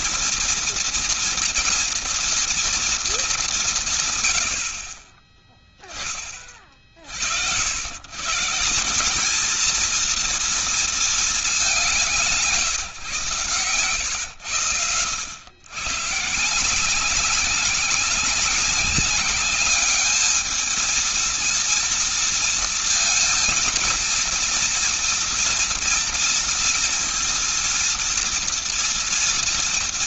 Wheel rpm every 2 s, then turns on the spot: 230, 230, 90, 30, 150, 230, 160, 120, 150, 200, 220, 230, 230, 230, 230.
none